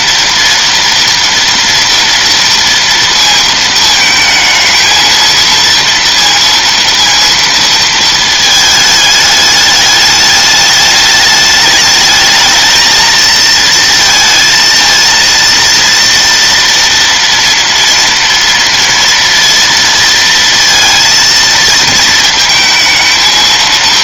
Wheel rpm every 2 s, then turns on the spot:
230, 230, 220, 230, 220, 210, 220, 230, 230, 230, 230, 220.
none